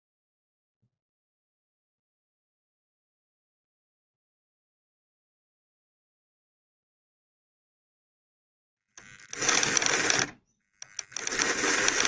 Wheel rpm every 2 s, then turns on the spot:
0, 0, 0, 0, 0, 10.
10-12